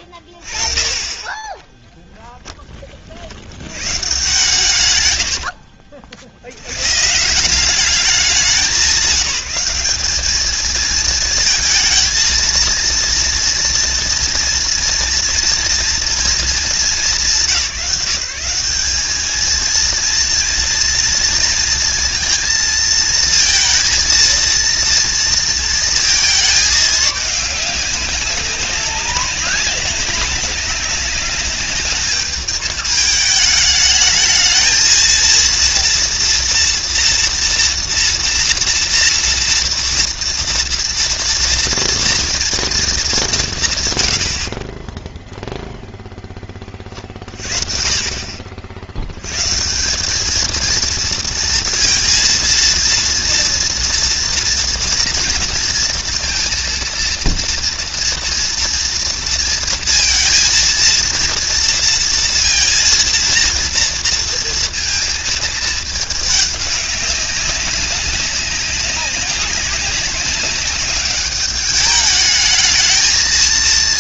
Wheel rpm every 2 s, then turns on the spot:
20, 40, 110, 130, 190, 220, 230, 230, 180, 190, 230, 230, 230, 210, 190, 200, 210, 230, 230, 230, 230, 210, 20, 30, 80, 220, 230, 230, 230, 230, 230, 230, 230, 200, 200, 200, 220.
4-6